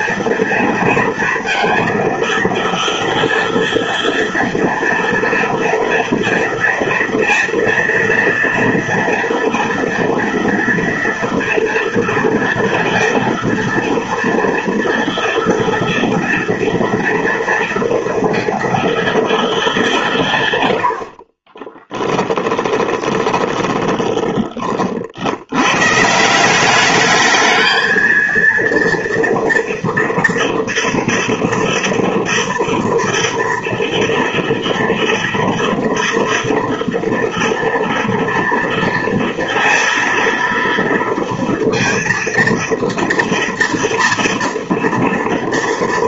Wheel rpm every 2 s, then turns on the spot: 230, 230, 230, 240, 230, 230, 230, 230, 230, 230, 70, 20, 50, 200, 230, 230, 230, 230, 230, 230, 230, 240, 230.
20-24